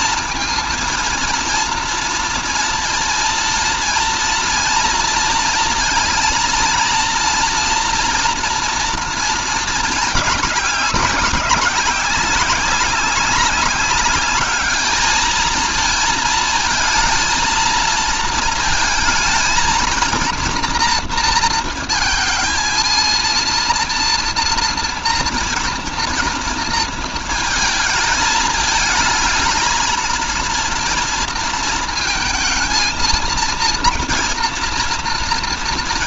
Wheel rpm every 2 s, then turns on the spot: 230, 230, 230, 230, 230, 190, 190, 210, 230, 220, 230, 230, 230, 230, 220, 230, 230, 230.
none